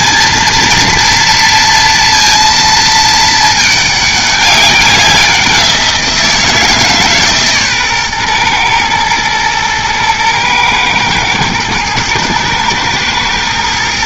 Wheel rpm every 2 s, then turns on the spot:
230, 230, 200, 160, 120, 110, 110.
none